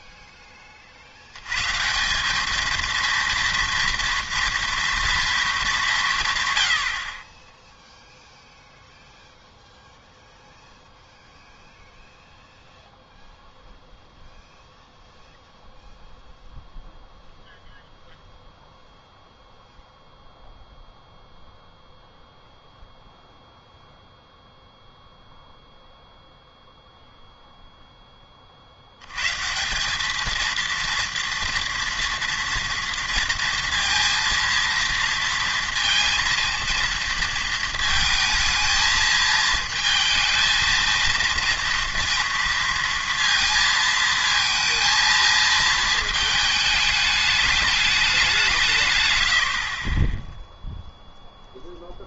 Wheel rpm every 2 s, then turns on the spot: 20, 220, 230, 80, 0, 0, 0, 0, 0, 0, 0, 0, 0, 0, 60, 230, 230, 230, 230, 220, 230, 230, 230, 210, 150, 0.
none